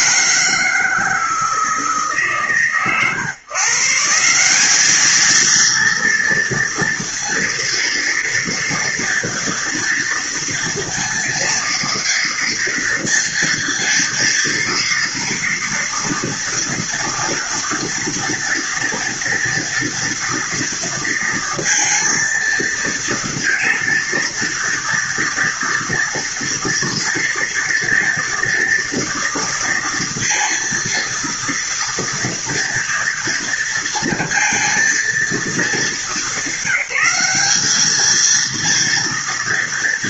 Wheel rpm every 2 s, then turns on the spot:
160, 140, 200, 230, 230, 230, 230, 230, 230, 240, 230, 230, 230, 240, 230, 230, 230, 230, 190, 230.
none